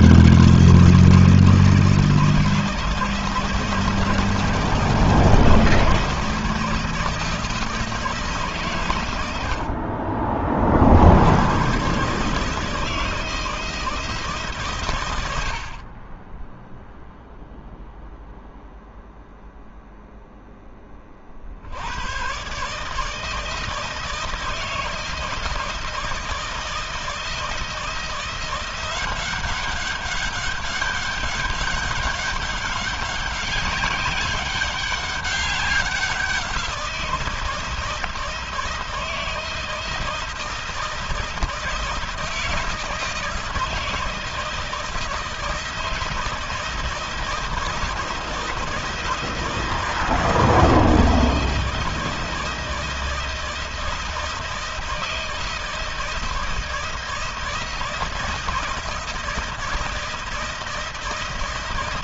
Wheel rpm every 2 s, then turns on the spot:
170, 160, 170, 160, 110, 70, 160, 110, 0, 0, 30, 150, 160, 160, 190, 200, 200, 200, 170, 160, 160, 160, 160, 160, 160, 160, 160, 160, 160, 160, 160.
none